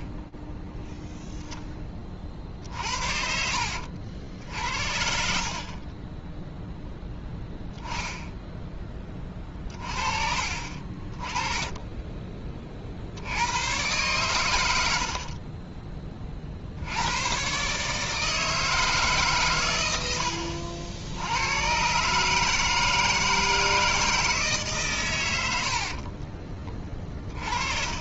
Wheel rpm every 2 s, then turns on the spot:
10, 30, 80, 30, 10, 40, 30, 110, 70, 160, 70, 160, 150, 50.
none